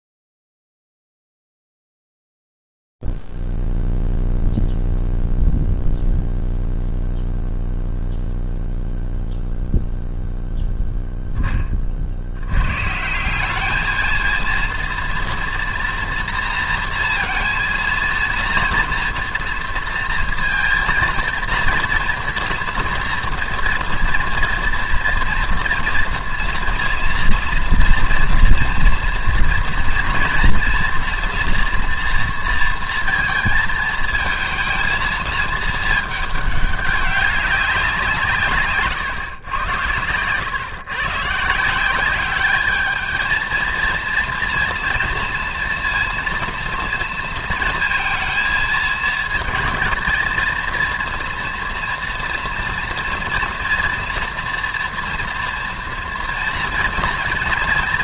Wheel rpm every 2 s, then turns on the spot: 0, 0, 0, 0, 0, 0, 70, 230, 240, 230, 230, 230, 230, 230, 230, 230, 230, 230, 200, 130, 120, 210, 230, 230, 220, 230, 240, 240, 230.
none